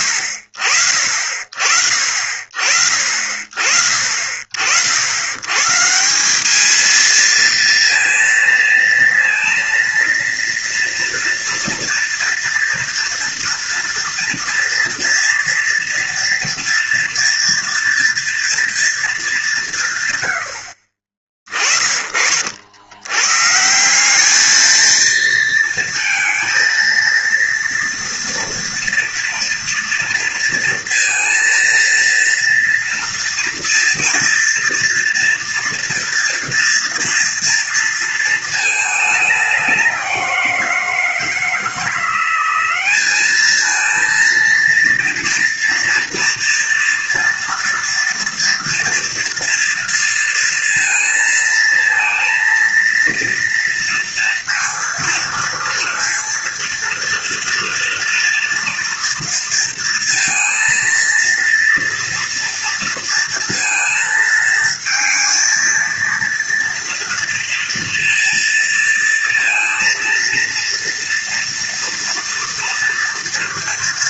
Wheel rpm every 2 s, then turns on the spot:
40, 40, 80, 210, 230, 230, 230, 230, 230, 230, 60, 70, 220, 230, 230, 230, 240, 230, 230, 220, 180, 190, 230, 230, 230, 230, 230, 230, 230, 230, 230, 230, 230, 230, 230, 230, 230.
none